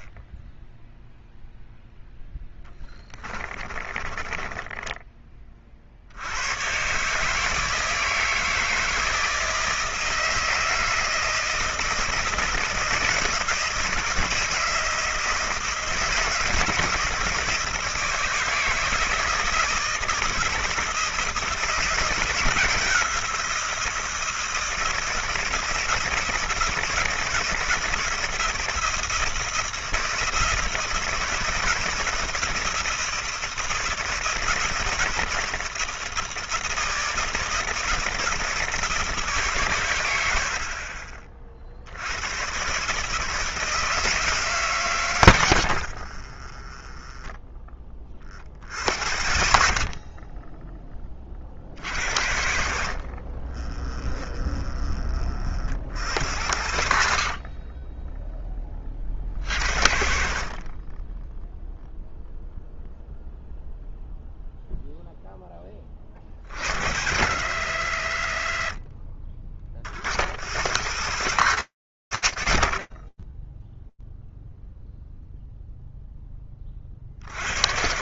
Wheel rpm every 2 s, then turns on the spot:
10, 10, 20, 110, 160, 160, 160, 160, 160, 170, 160, 170, 160, 160, 170, 160, 160, 160, 160, 160, 50, 120, 130, 20, 60, 20, 60, 20, 70, 30, 40, 0, 0, 60, 40, 90, 0, 0, 30.
2-6 48-52 56-58